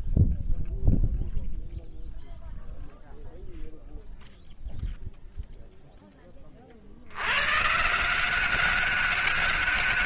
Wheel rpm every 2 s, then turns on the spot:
0, 0, 0, 120, 200.
none